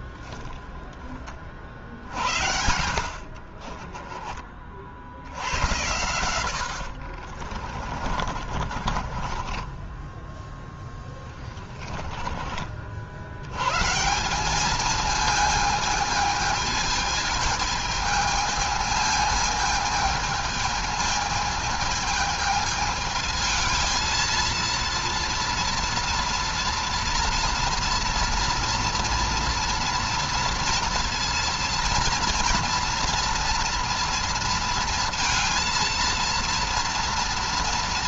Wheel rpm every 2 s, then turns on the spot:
10, 70, 50, 70, 30, 10, 60, 220, 220, 220, 220, 220, 230, 230, 230, 230, 240, 230, 230.
2-4 6-12